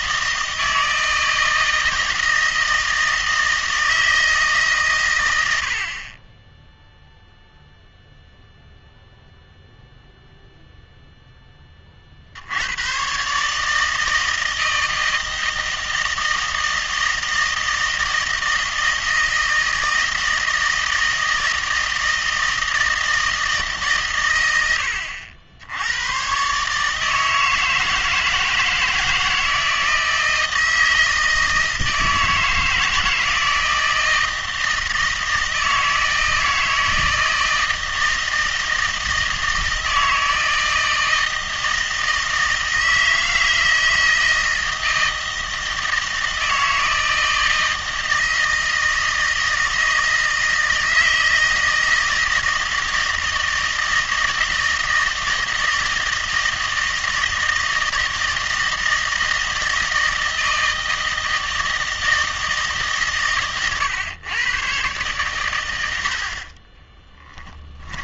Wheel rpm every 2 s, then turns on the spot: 160, 160, 150, 10, 0, 0, 90, 160, 160, 160, 160, 160, 90, 150, 160, 160, 160, 160, 160, 160, 160, 160, 170, 160, 160, 160, 160, 160, 160, 160, 160, 160, 130, 30.
66-68